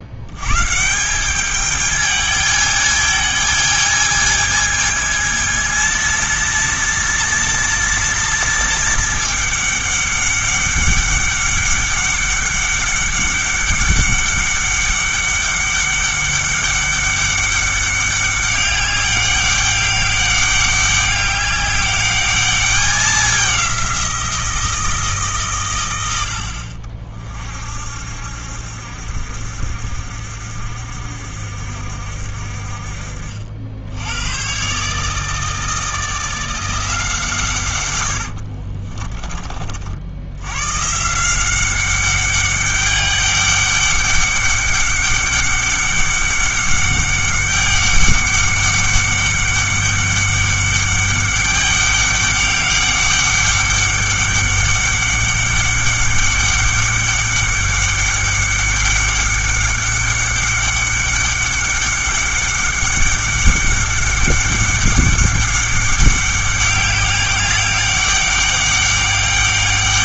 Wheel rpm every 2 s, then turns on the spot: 140, 220, 220, 230, 230, 200, 200, 200, 200, 200, 200, 200, 170, 60, 70, 60, 50, 130, 170, 40, 120, 200, 200, 200, 200, 200, 200, 200, 200, 200, 200, 200, 200, 200, 200.
38-40